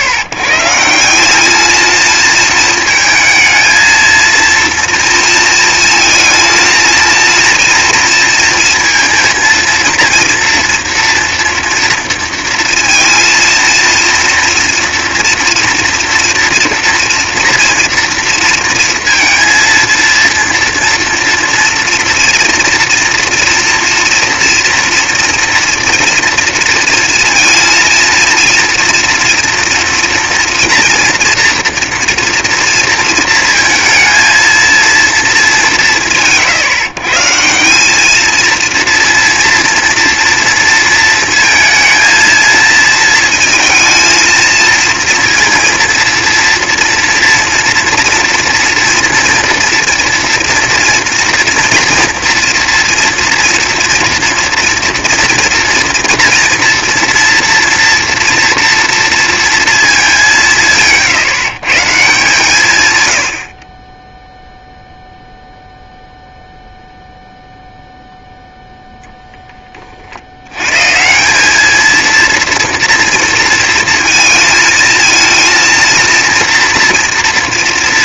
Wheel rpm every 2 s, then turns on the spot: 130, 220, 230, 230, 230, 230, 230, 230, 230, 230, 230, 230, 230, 230, 230, 230, 230, 230, 160, 230, 230, 220, 230, 240, 230, 240, 230, 240, 240, 240, 160, 140, 0, 0, 0, 90, 230, 230, 230.
none